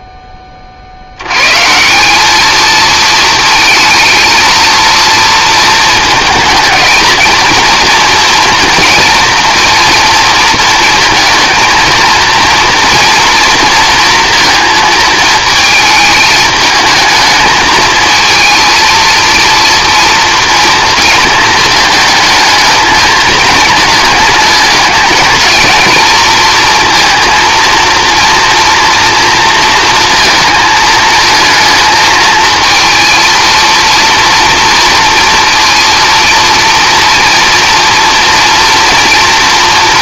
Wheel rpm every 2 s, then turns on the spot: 40, 220, 230, 220, 230, 220, 230, 230, 220, 230, 230, 220, 210, 230, 230, 220, 220, 230, 230, 240.
none